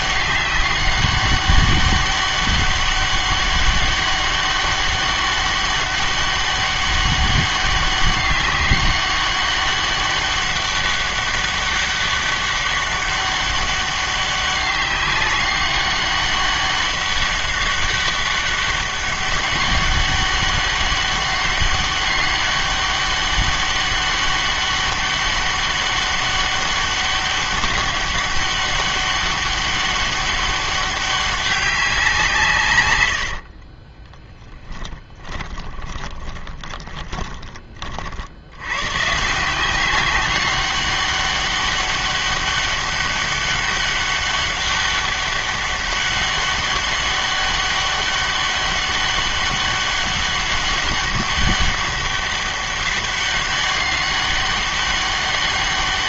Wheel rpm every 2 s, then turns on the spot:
200, 200, 200, 200, 200, 200, 200, 200, 200, 200, 200, 200, 200, 200, 200, 200, 130, 20, 20, 100, 200, 200, 200, 200, 200, 200, 200, 200.
34-38